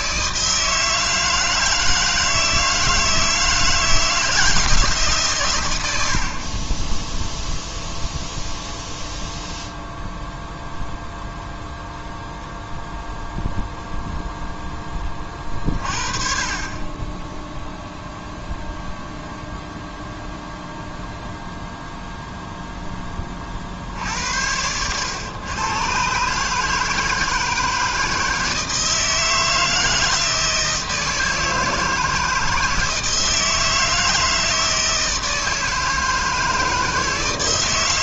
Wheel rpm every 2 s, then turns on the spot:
160, 160, 160, 0, 0, 0, 0, 20, 20, 0, 0, 10, 110, 160, 160, 160, 160, 160, 160.
16-18